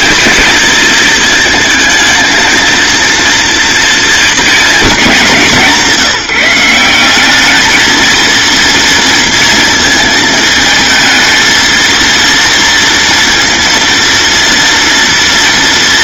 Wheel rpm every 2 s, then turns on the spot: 230, 230, 210, 200, 230, 220, 230, 230.
none